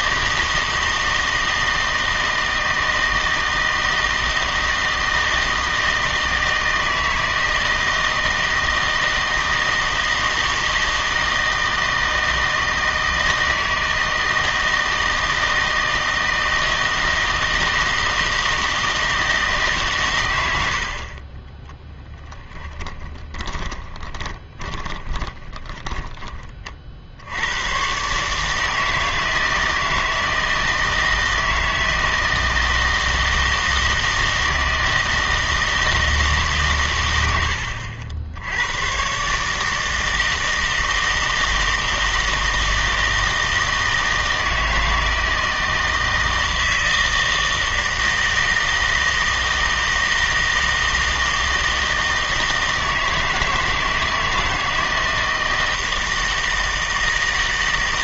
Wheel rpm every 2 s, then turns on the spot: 160, 160, 160, 160, 160, 160, 160, 160, 160, 160, 80, 10, 20, 40, 160, 160, 160, 160, 130, 100, 160, 160, 160, 160, 160, 160, 160, 160, 160.
22-26